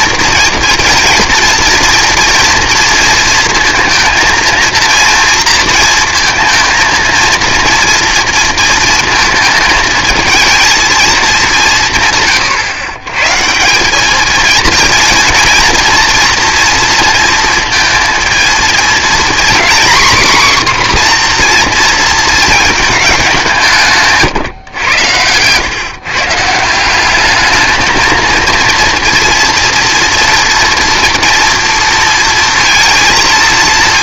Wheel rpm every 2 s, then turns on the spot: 230, 230, 230, 230, 230, 230, 130, 230, 230, 230, 260, 220, 110, 170, 230, 230, 230.
none